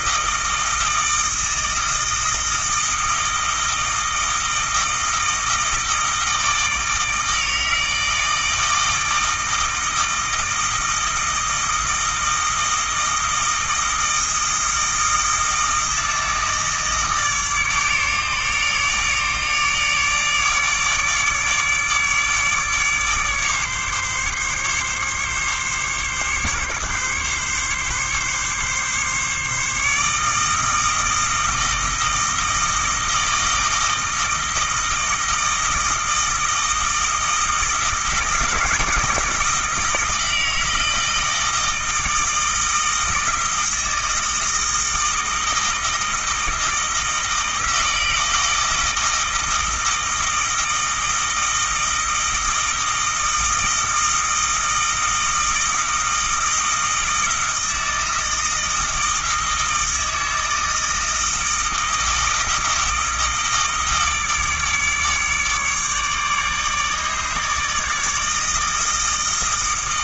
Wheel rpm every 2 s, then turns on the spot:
160, 160, 160, 160, 160, 160, 160, 160, 160, 150, 150, 150, 140, 140, 140, 160, 160, 160, 160, 160, 160, 160, 160, 160, 160, 160, 160, 160, 160, 160, 160, 160, 150, 150, 160.
none